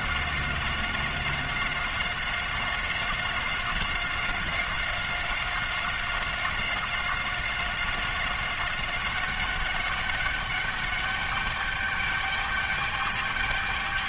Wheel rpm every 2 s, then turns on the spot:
190, 190, 190, 190, 190, 200, 210.
none